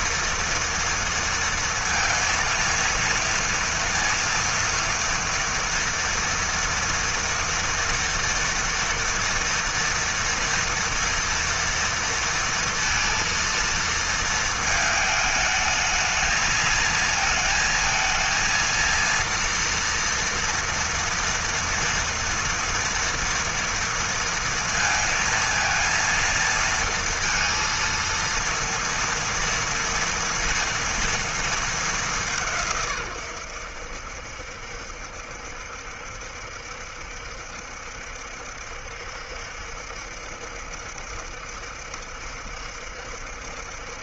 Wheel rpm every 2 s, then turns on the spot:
230, 230, 230, 240, 230, 230, 230, 220, 220, 230, 230, 230, 230, 230, 230, 230, 130, 70, 70, 70, 70, 70.
none